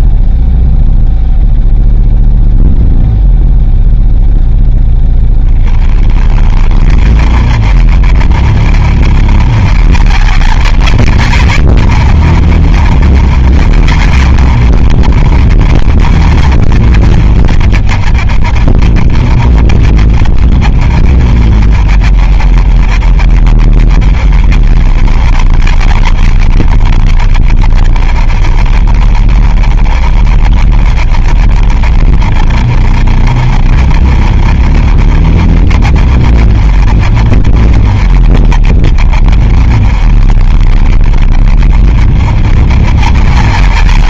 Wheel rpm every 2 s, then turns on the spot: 0, 0, 0, 20, 30, 50, 40, 40, 40, 30, 30, 30, 30, 40, 30, 30, 30, 30, 30, 30, 30, 30.
none